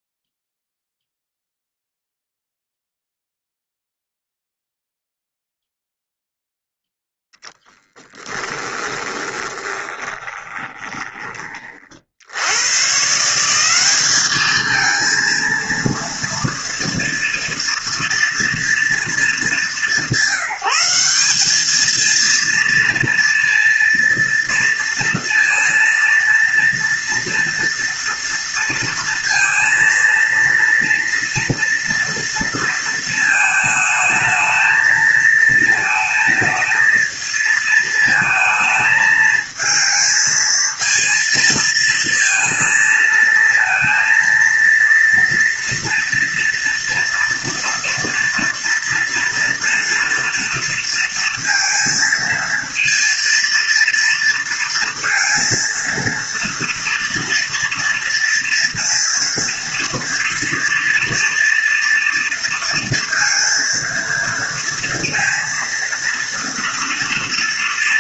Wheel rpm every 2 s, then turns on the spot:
0, 0, 0, 10, 20, 20, 170, 230, 240, 210, 200, 230, 230, 230, 230, 230, 220, 220, 220, 220, 230, 230, 230, 230, 230, 230, 230, 230, 230, 230, 240, 230, 230, 230.
8-10